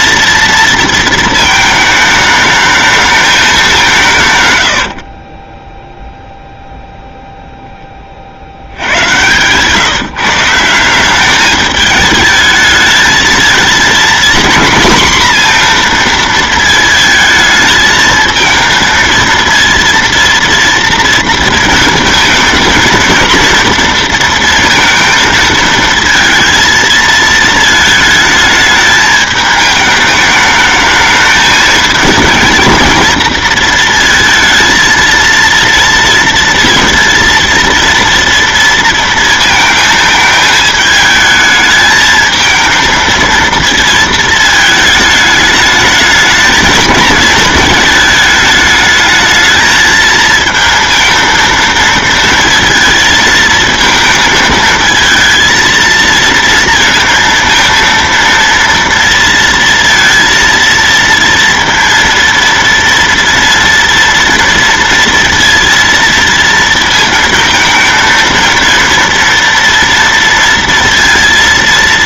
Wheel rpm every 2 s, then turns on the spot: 230, 210, 100, 0, 70, 170, 210, 240, 230, 220, 230, 220, 230, 230, 220, 210, 230, 230, 230, 230, 220, 220, 220, 220, 220, 230, 230, 220, 230, 230, 230, 230, 230, 230, 230, 230.
none